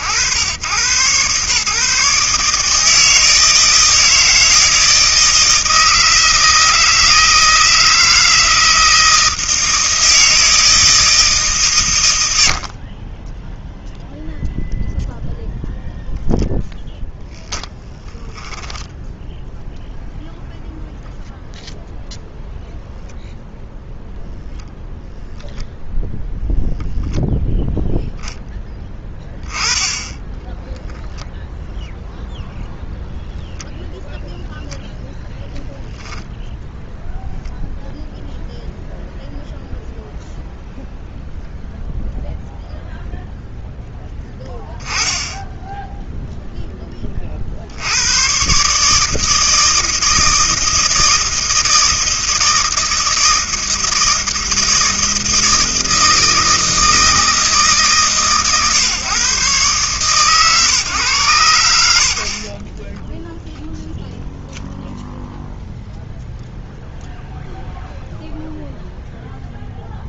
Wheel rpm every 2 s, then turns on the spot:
120, 150, 160, 160, 160, 160, 30, 0, 0, 0, 0, 0, 0, 0, 10, 0, 0, 0, 0, 0, 0, 0, 10, 10, 150, 160, 160, 160, 160, 130, 130, 30, 0, 0, 0.
28-30 62-64